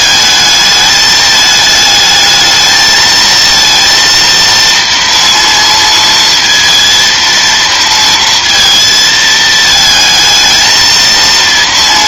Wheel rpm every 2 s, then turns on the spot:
220, 220, 230, 230, 230, 220.
none